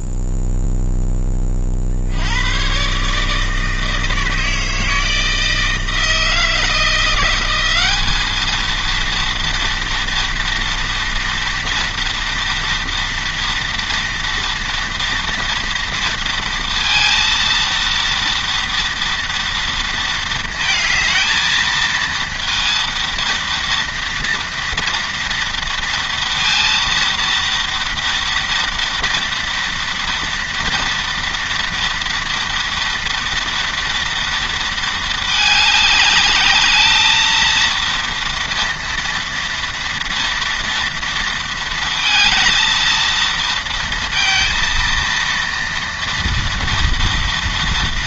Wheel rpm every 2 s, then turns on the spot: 0, 120, 160, 170, 220, 230, 230, 230, 230, 230, 220, 230, 230, 230, 240, 230, 230, 220, 220, 230, 230, 230, 230, 230.
none